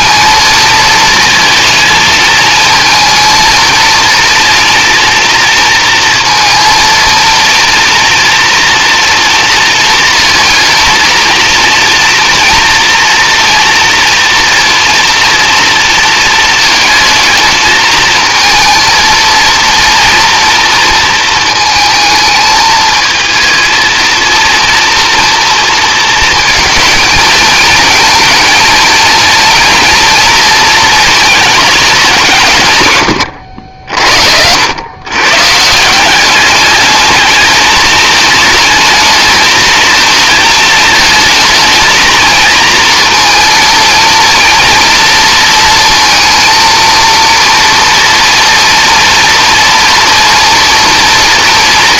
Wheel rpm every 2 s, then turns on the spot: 230, 220, 230, 230, 230, 230, 230, 230, 220, 230, 240, 220, 230, 220, 230, 230, 130, 110, 200, 220, 220, 230, 230, 230, 230, 230.
none